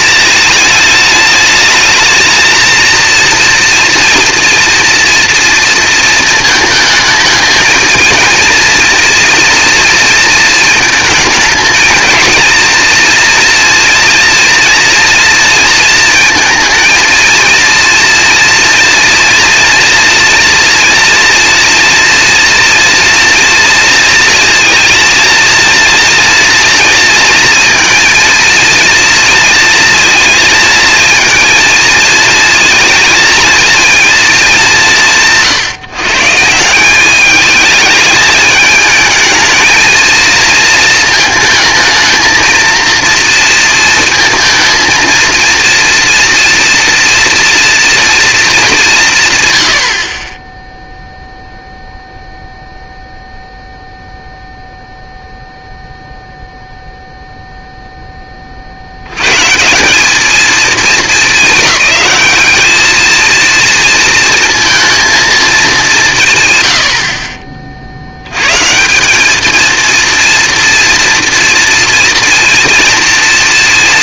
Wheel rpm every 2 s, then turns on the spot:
220, 230, 230, 230, 230, 230, 230, 230, 230, 230, 240, 230, 230, 230, 230, 230, 220, 140, 210, 230, 230, 230, 230, 230, 120, 0, 0, 0, 0, 80, 220, 220, 230, 80, 170, 230, 230.
none